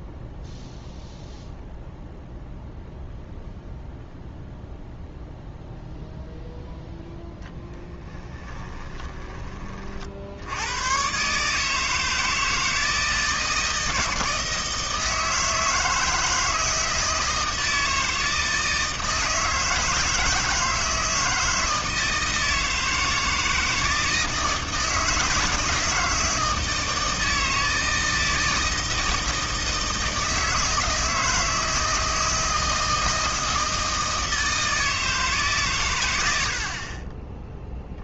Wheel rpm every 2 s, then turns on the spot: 0, 0, 0, 0, 20, 110, 160, 160, 160, 160, 160, 160, 160, 160, 160, 160, 160, 160, 50.
8-10 36-38